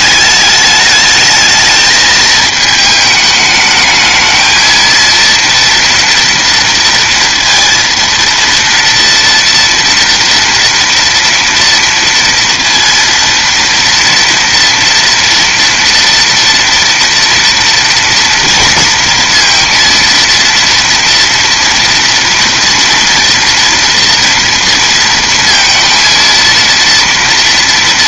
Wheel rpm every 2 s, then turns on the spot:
210, 220, 230, 230, 230, 230, 230, 230, 230, 230, 230, 230, 230, 230.
none